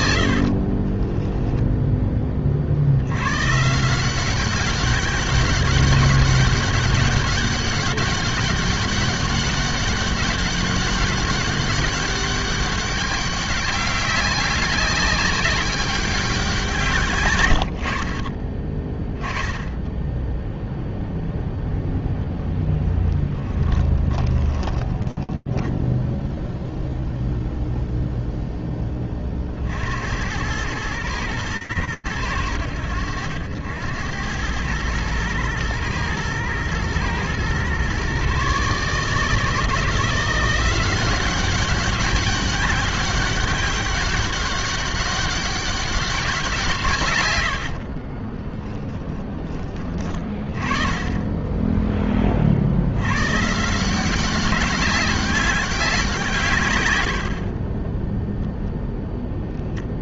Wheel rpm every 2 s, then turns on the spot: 60, 40, 190, 200, 190, 200, 200, 200, 180, 20, 0, 0, 20, 0, 20, 110, 80, 110, 120, 160, 190, 200, 200, 100, 30, 20, 180, 190, 20, 0.
0-2 24-26 46-48